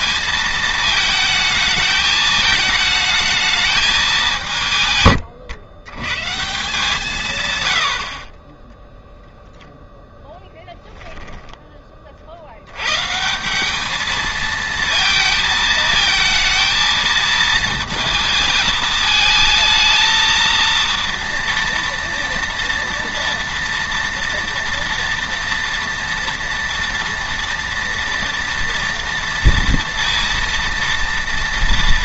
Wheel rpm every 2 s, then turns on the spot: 220, 220, 170, 160, 10, 0, 100, 230, 230, 220, 230, 230, 240, 230, 230, 230.
8-10